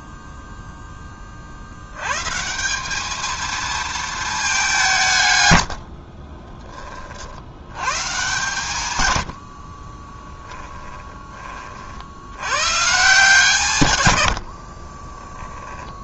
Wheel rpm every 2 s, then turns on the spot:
10, 190, 190, 20, 120, 10, 130, 30.
10-12 14-16